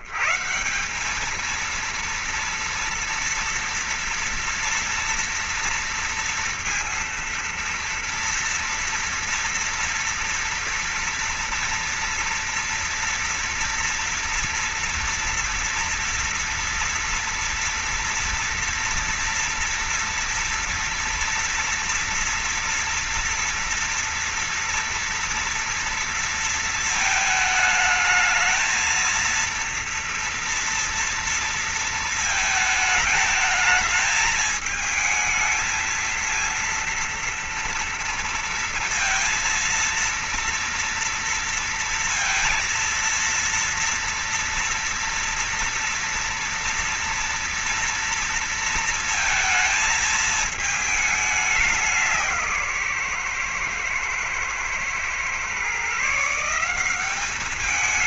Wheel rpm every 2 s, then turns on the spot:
140, 220, 230, 230, 230, 240, 230, 230, 230, 230, 230, 230, 230, 230, 220, 230, 230, 220, 230, 230, 230, 230, 230, 230, 230, 220, 180, 120, 150.
none